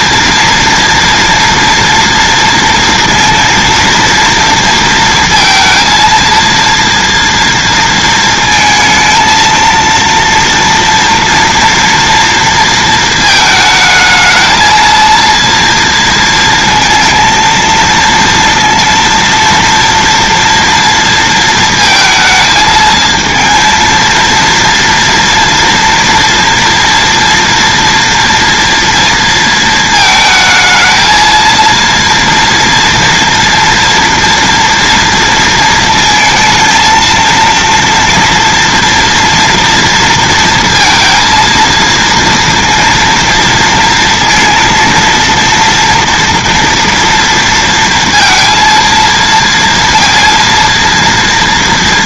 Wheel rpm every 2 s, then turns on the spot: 230, 230, 230, 230, 230, 230, 230, 220, 230, 230, 230, 220, 230, 230, 230, 220, 230, 230, 220, 230, 230, 230, 230, 240, 230, 230.
none